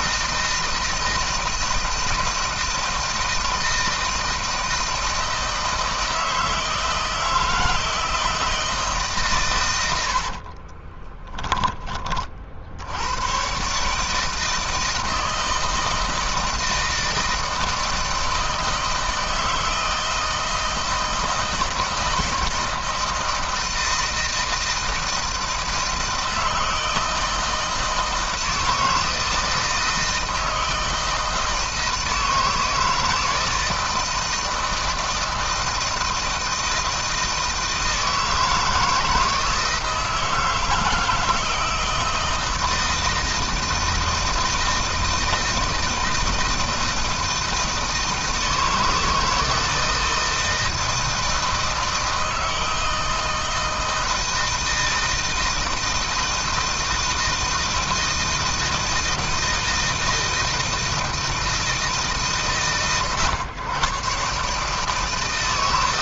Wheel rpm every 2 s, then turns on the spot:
160, 160, 160, 160, 150, 30, 80, 160, 160, 160, 160, 160, 160, 160, 160, 160, 160, 160, 160, 160, 170, 160, 160, 160, 160, 160, 160, 160, 160, 160, 160, 120, 150.
10-12